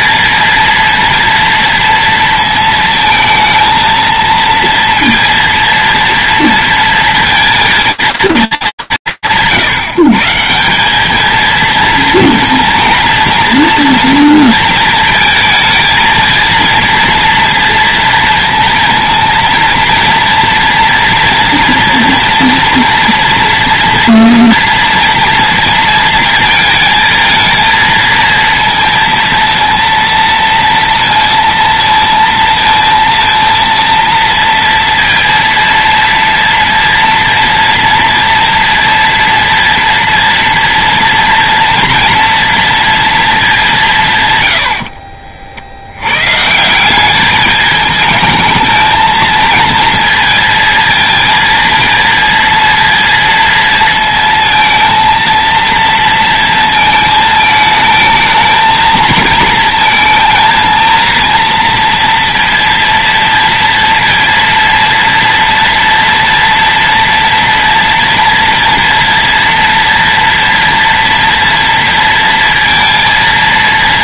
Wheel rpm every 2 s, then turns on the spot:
230, 220, 230, 230, 200, 150, 230, 230, 230, 230, 230, 230, 230, 230, 230, 230, 230, 230, 230, 230, 230, 230, 120, 130, 220, 230, 230, 230, 230, 220, 220, 230, 230, 230, 230, 230, 230.
none